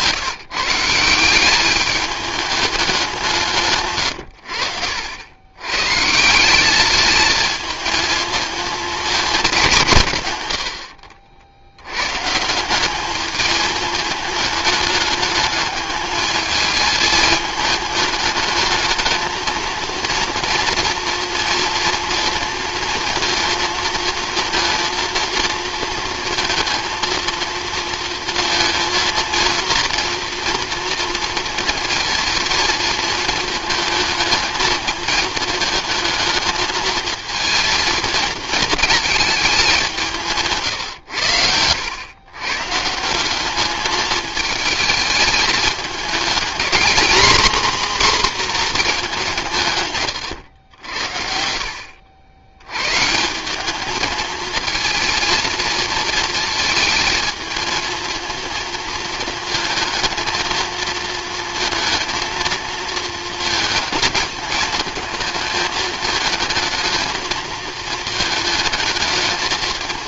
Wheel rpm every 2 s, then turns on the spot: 170, 200, 70, 200, 220, 90, 180, 210, 220, 220, 240, 220, 230, 230, 230, 230, 230, 220, 220, 220, 140, 140, 220, 240, 230, 100, 100, 230, 220, 230, 220, 220, 220, 220, 220.
4-6